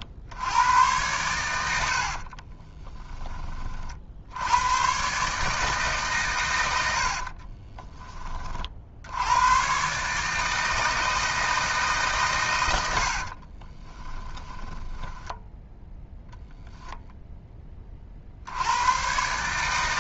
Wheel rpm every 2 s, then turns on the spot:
100, 30, 110, 80, 60, 160, 90, 10, 0, 100.
2-4 12-16